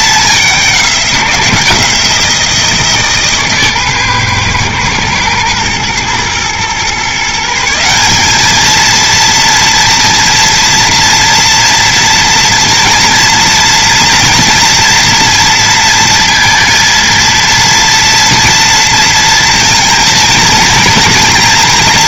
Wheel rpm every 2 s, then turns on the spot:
190, 160, 120, 120, 220, 230, 230, 240, 230, 230, 230.
none